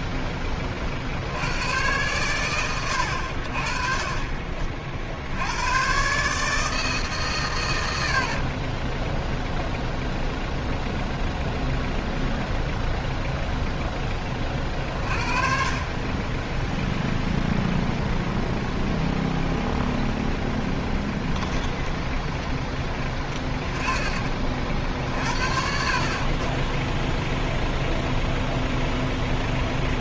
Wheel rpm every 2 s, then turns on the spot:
50, 90, 60, 140, 10, 0, 0, 40, 0, 0, 10, 10, 50, 10, 0.
20-24